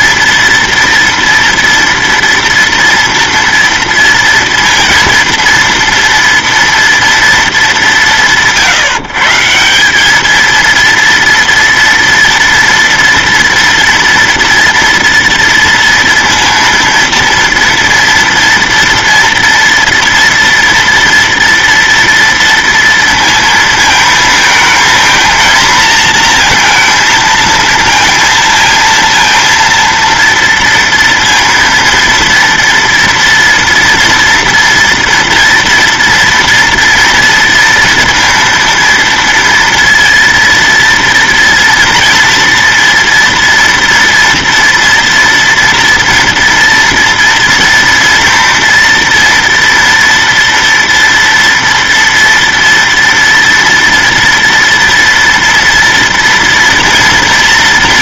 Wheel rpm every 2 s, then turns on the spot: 230, 230, 230, 230, 150, 230, 240, 230, 230, 230, 240, 230, 220, 220, 230, 230, 230, 230, 230, 230, 230, 230, 230, 230, 230, 230, 230, 230, 230.
none